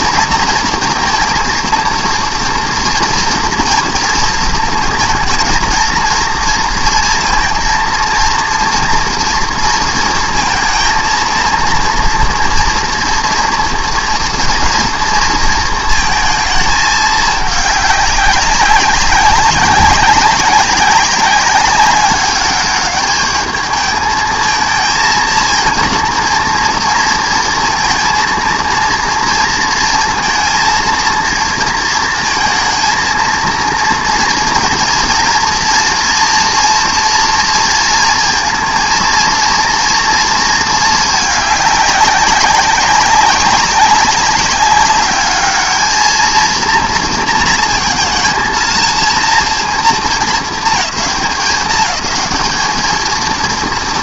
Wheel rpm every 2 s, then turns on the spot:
230, 230, 230, 230, 230, 230, 230, 230, 220, 200, 190, 210, 230, 230, 230, 230, 230, 230, 240, 230, 220, 200, 200, 230, 230, 220, 220.
none